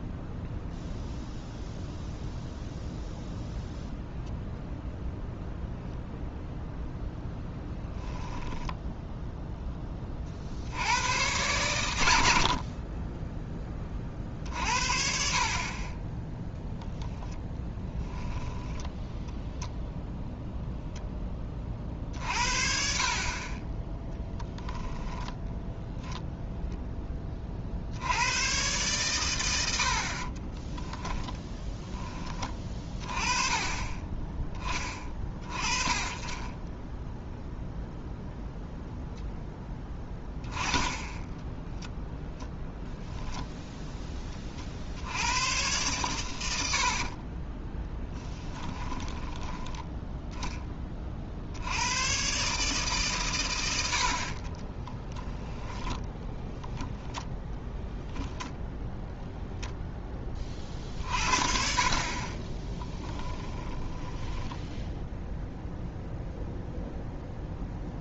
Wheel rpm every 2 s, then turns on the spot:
0, 0, 0, 0, 10, 50, 60, 50, 0, 20, 0, 50, 10, 0, 110, 30, 20, 20, 20, 0, 10, 0, 30, 90, 20, 10, 140, 40, 10, 0, 30, 30, 10, 0.
8-10 18-20 30-32 48-50 54-58 62-66